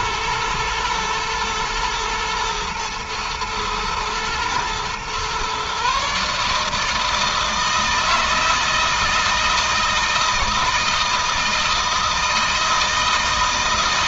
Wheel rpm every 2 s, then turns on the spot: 110, 110, 120, 160, 160, 160, 160.
none